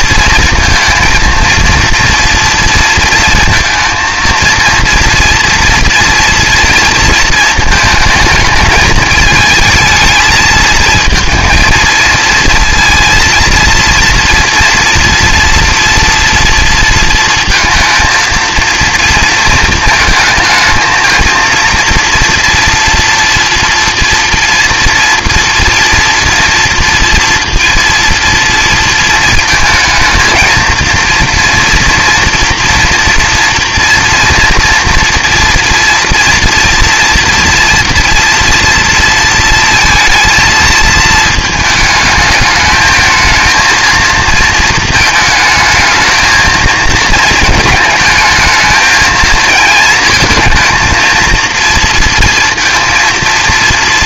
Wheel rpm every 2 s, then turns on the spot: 230, 230, 230, 230, 210, 220, 230, 230, 230, 230, 220, 240, 230, 230, 220, 230, 230, 230, 230, 230, 220, 220, 220, 220, 220, 230, 230.
none